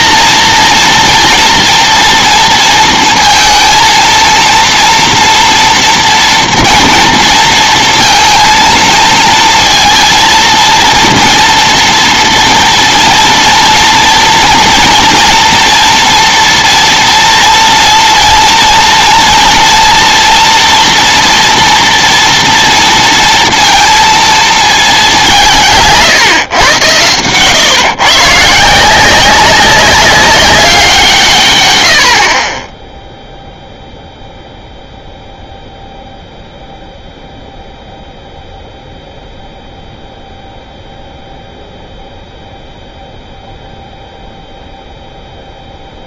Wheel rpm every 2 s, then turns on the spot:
230, 230, 230, 230, 230, 230, 230, 230, 230, 230, 230, 230, 210, 110, 170, 190, 10, 0, 0, 0, 0, 0, 0.
none